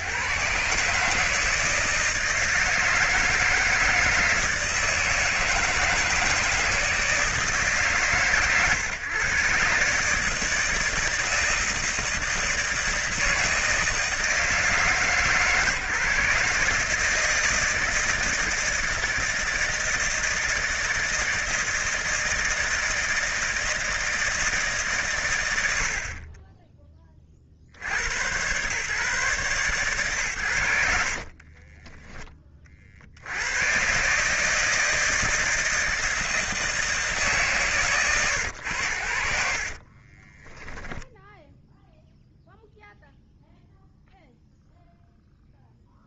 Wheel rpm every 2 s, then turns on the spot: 130, 160, 160, 160, 130, 160, 160, 160, 150, 160, 160, 160, 150, 20, 120, 120, 30, 150, 160, 100, 20, 0, 0.
40-42